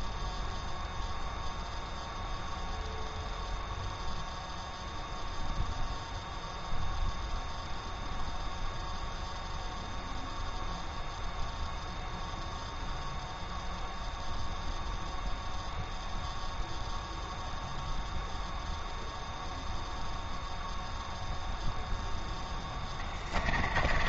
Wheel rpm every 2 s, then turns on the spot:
0, 0, 0, 0, 0, 0, 0, 0, 0, 0, 0, 20.
22-24